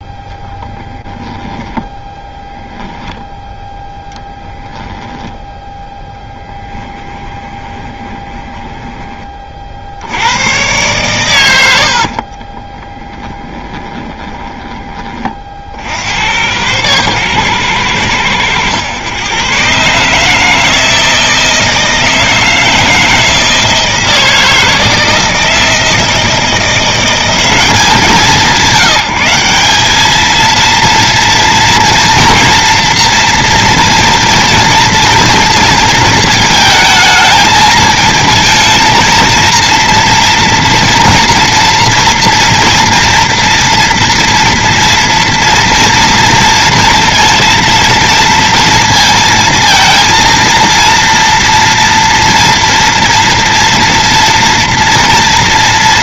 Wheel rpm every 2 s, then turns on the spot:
20, 0, 10, 10, 20, 110, 10, 30, 110, 110, 160, 160, 160, 170, 170, 230, 240, 230, 220, 230, 230, 230, 230, 230, 230, 230, 230, 230.
4-8 12-14